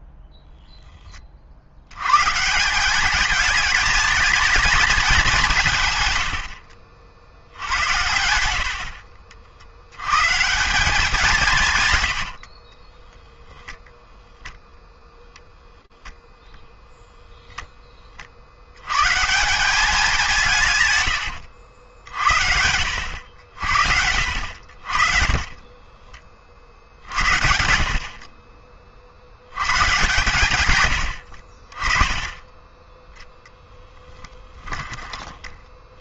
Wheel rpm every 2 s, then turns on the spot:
0, 170, 220, 60, 70, 170, 60, 0, 0, 100, 120, 80, 60, 60, 60, 90, 10, 20.
6-8 12-14 20-22